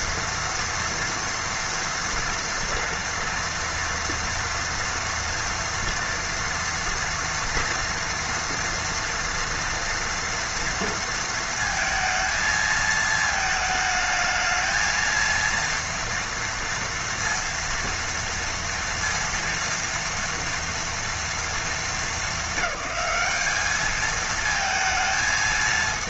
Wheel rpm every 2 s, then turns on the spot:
230, 240, 240, 240, 230, 230, 230, 220, 230, 230, 230, 210, 220.
none